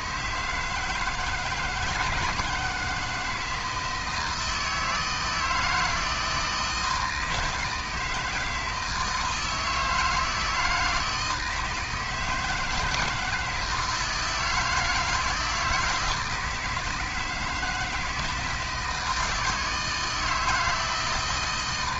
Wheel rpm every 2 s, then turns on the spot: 160, 160, 160, 160, 160, 160, 160, 160, 160, 160, 160.
none